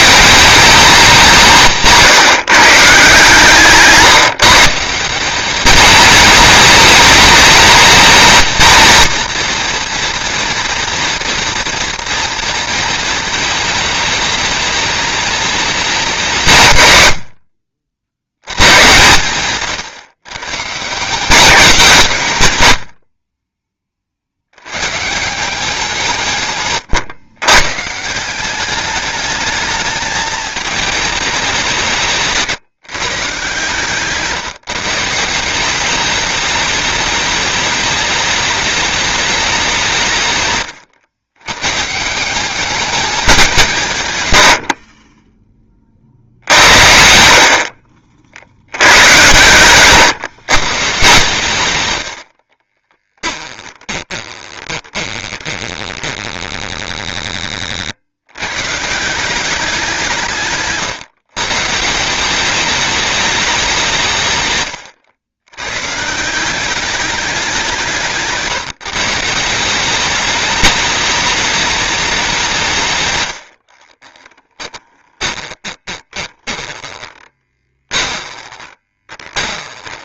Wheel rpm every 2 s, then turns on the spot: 190, 150, 160, 210, 220, 230, 230, 210, 130, 110, 140, 110, 110, 130, 200, 220, 160, 160, 210, 210, 120, 200, 60, 80, 80, 120, 40, 20, 10, 140, 140, 200, 120, 190, 160, 210, 160, 20, 20, 20.
40-42 52-58 74-80